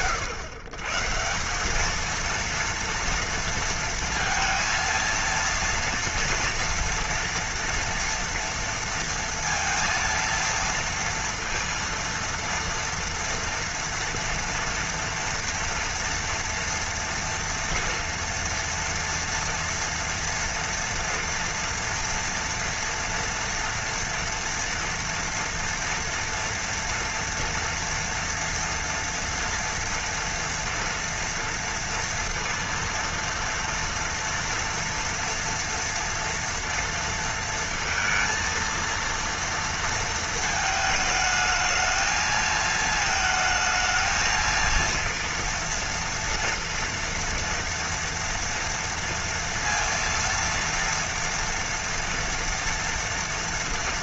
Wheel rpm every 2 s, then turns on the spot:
120, 230, 230, 230, 230, 230, 230, 230, 240, 230, 230, 230, 230, 230, 230, 230, 230, 230, 230, 230, 220, 220, 230, 230, 230, 230, 230.
none